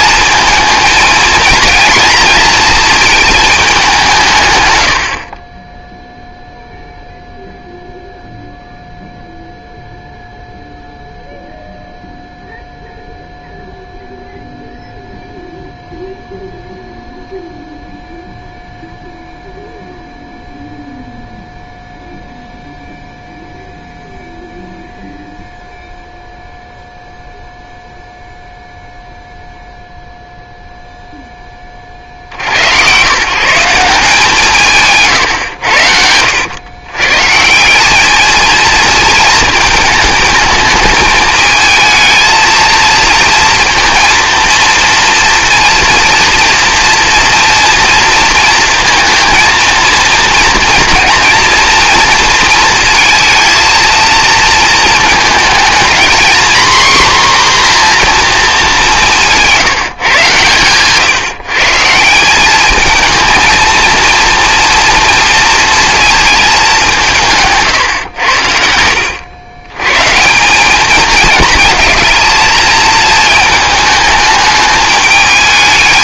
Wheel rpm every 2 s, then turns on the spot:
230, 170, 0, 0, 0, 0, 0, 0, 0, 0, 0, 0, 0, 0, 0, 0, 110, 160, 110, 220, 220, 220, 230, 230, 230, 230, 230, 230, 250, 210, 130, 210, 230, 200, 80, 200, 220, 210.
68-70